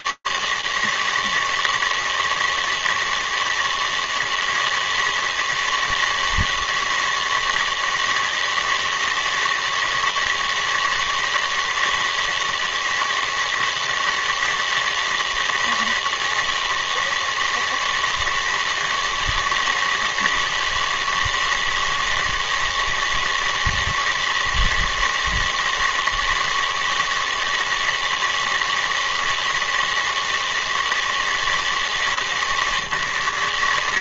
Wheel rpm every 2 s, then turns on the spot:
160, 160, 160, 160, 160, 160, 160, 160, 160, 160, 160, 160, 160, 160, 160, 160, 140.
none